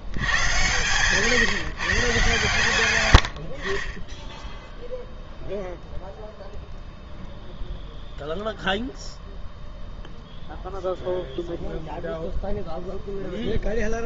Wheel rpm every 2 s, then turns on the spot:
120, 110, 0, 0, 0, 0, 0.
none